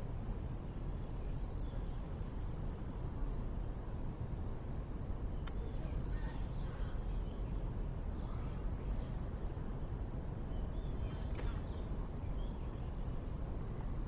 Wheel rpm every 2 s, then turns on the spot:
0, 0, 0, 0, 0, 0, 0.
none